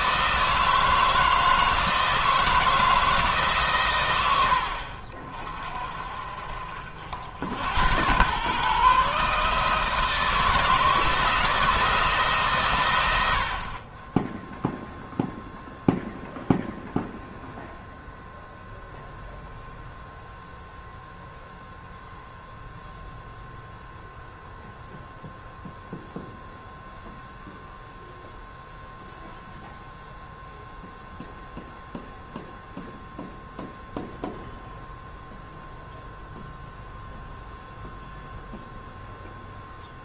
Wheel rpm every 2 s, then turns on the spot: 160, 160, 70, 60, 130, 160, 120, 0, 0, 0, 0, 0, 0, 0, 0, 0, 0, 0, 0, 0.
none